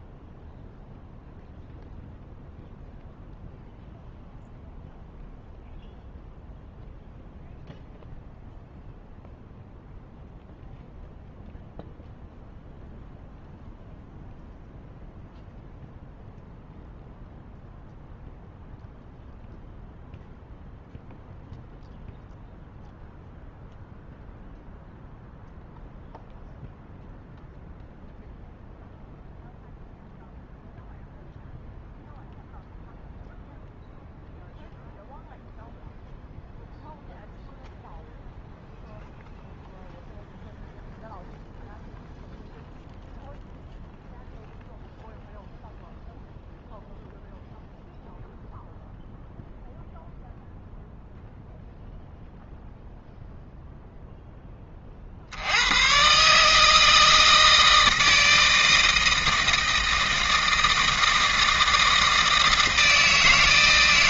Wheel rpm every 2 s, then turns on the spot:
0, 0, 0, 0, 0, 0, 0, 0, 0, 0, 0, 0, 0, 0, 0, 0, 0, 0, 0, 0, 0, 0, 0, 0, 0, 0, 0, 30, 160, 160, 160, 160.
none